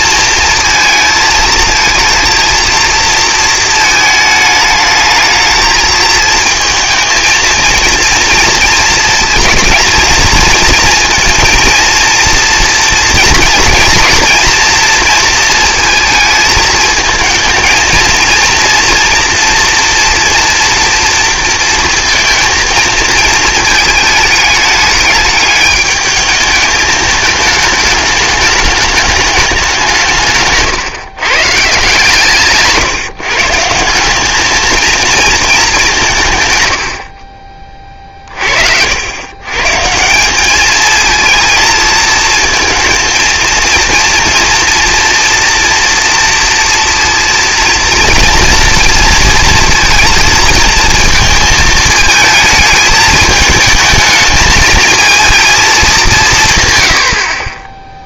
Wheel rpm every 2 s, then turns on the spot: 230, 230, 220, 220, 230, 230, 230, 230, 220, 230, 230, 230, 210, 210, 210, 150, 140, 220, 110, 60, 210, 230, 230, 230, 230, 230, 220, 220, 110.
30-32